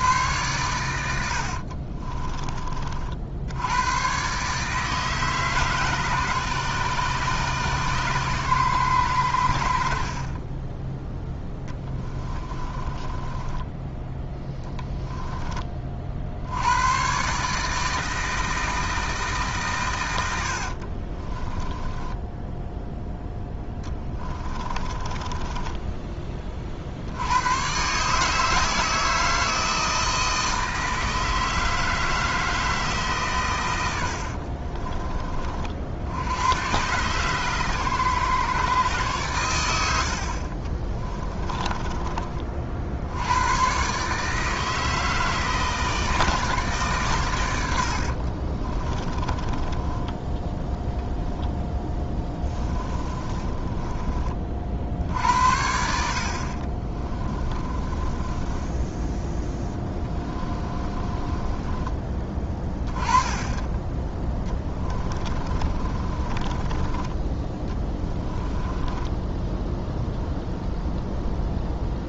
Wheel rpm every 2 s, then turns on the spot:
100, 30, 150, 140, 120, 20, 20, 10, 80, 160, 60, 10, 20, 50, 160, 160, 160, 50, 110, 130, 30, 50, 160, 150, 30, 30, 20, 50, 40, 10, 20, 10, 20, 20, 20, 0.
12-16 20-22 24-26 34-36 40-42 48-54 56-62 64-70